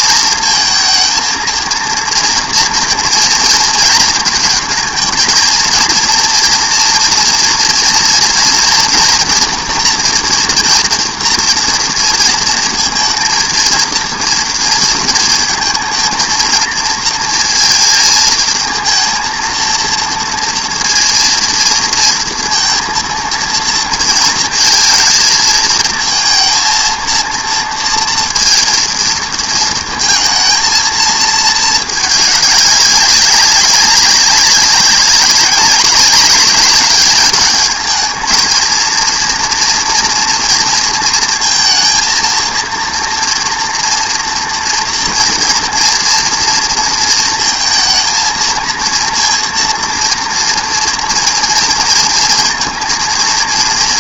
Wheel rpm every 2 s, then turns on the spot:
230, 230, 220, 230, 230, 230, 230, 230, 230, 220, 230, 230, 230, 230, 230, 220, 200, 200, 200, 230, 230, 230, 240, 230, 230, 230, 230.
none